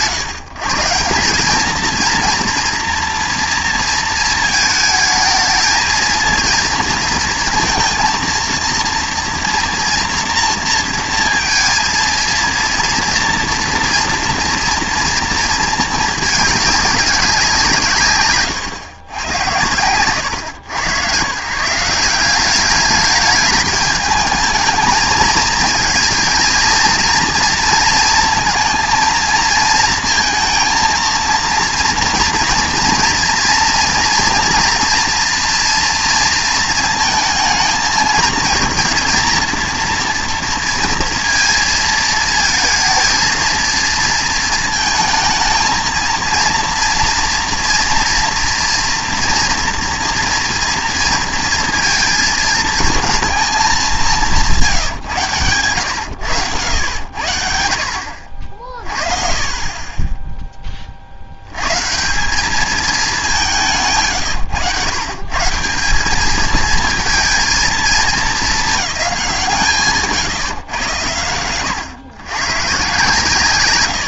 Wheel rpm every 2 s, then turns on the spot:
140, 230, 220, 230, 230, 230, 230, 230, 200, 110, 110, 200, 220, 230, 230, 230, 230, 230, 230, 230, 230, 230, 230, 230, 230, 230, 220, 160, 110, 50, 30, 210, 100, 220, 200, 120, 120.
none